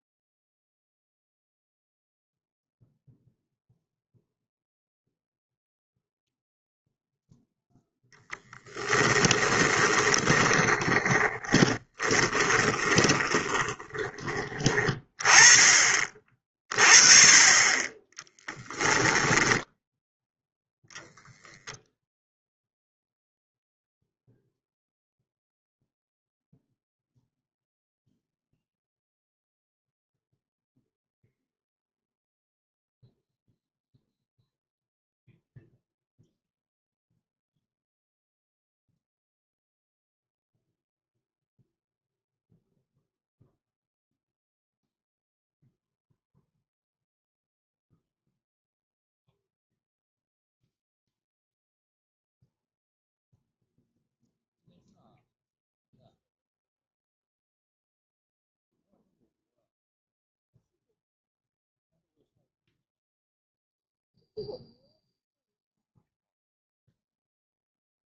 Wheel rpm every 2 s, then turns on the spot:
0, 0, 0, 0, 10, 20, 30, 20, 30, 10, 0, 0, 0, 0, 0, 0, 0, 0, 0, 0, 0, 0, 0, 0, 0, 0, 0, 0, 0, 0, 0, 0, 0, 0.
8-14 18-20